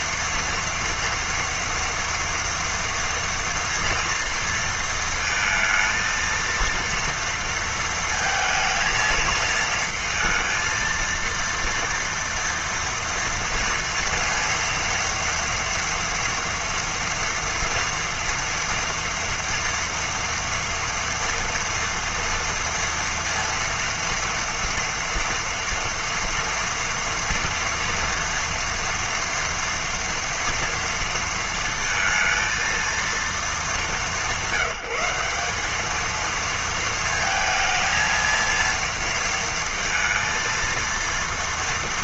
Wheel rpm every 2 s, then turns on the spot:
230, 230, 230, 230, 220, 230, 230, 230, 230, 230, 230, 230, 240, 230, 230, 230, 230, 190, 230, 230, 230.
none